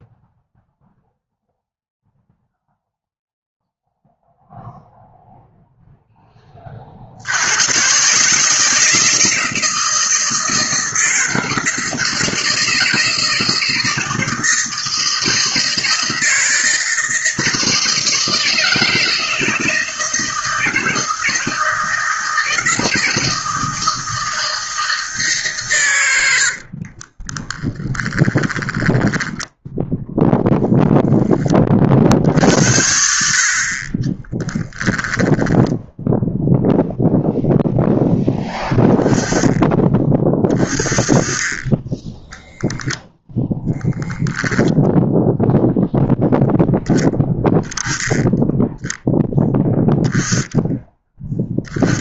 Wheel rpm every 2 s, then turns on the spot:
0, 0, 0, 50, 160, 160, 160, 160, 160, 160, 160, 160, 160, 40, 10, 10, 60, 10, 0, 10, 20, 0, 0, 10, 10, 10.
26-30 34-36